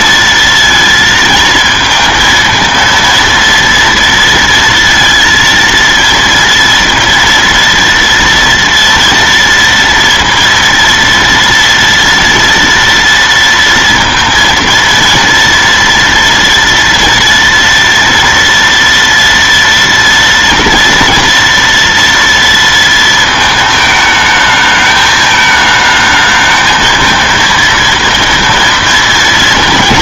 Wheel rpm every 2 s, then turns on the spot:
230, 230, 230, 230, 230, 230, 230, 230, 230, 230, 230, 230, 210, 220, 230.
none